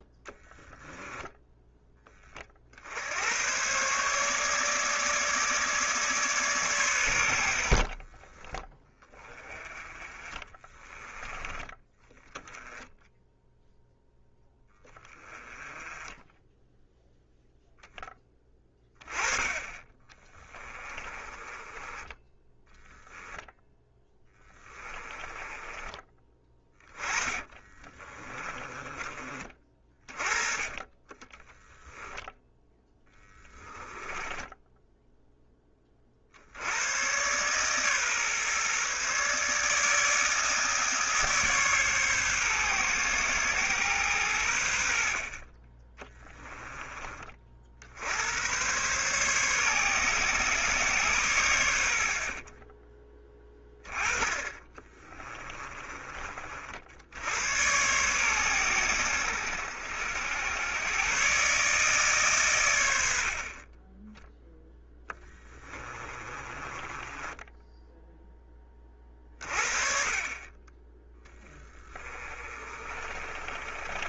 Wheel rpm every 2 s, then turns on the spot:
10, 70, 150, 110, 20, 20, 0, 10, 10, 20, 30, 10, 20, 20, 30, 20, 10, 0, 110, 140, 150, 120, 70, 30, 130, 130, 20, 20, 70, 100, 120, 70, 10, 20, 30, 10, 30.
0-2 20-30 32-34 52-56 64-68 72-74